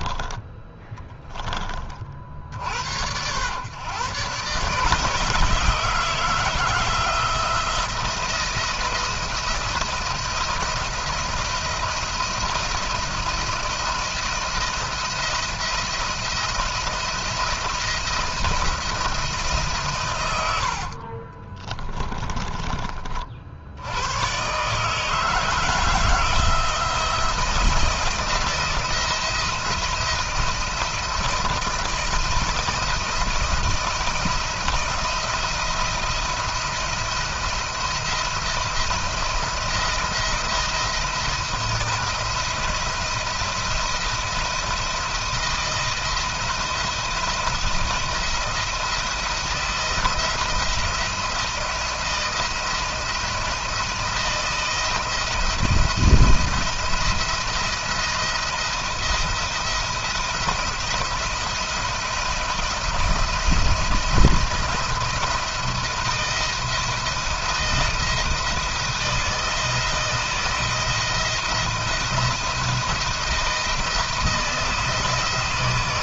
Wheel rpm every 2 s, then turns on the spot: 20, 60, 140, 170, 170, 170, 170, 170, 170, 170, 70, 40, 140, 160, 170, 170, 170, 170, 170, 170, 170, 170, 170, 170, 170, 170, 170, 170, 170, 170, 170, 160, 170, 170, 170, 170, 170, 160.
0-2 20-22